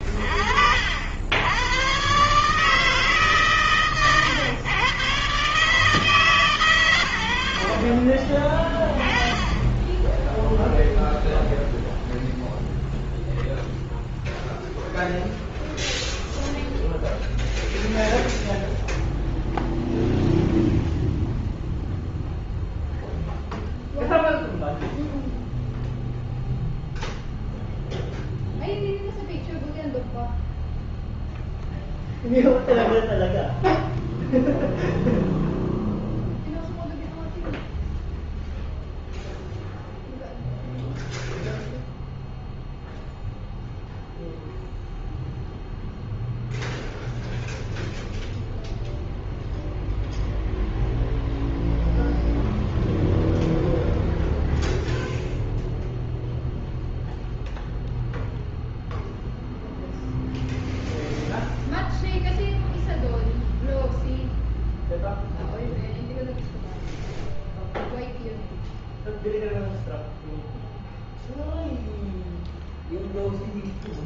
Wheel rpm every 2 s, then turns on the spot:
70, 150, 120, 140, 30, 0, 0, 0, 0, 0, 0, 0, 0, 0, 0, 0, 0, 0, 0, 0, 0, 0, 0, 0, 0, 0, 0, 0, 0, 0, 0, 0, 0, 0, 0, 0, 0.
none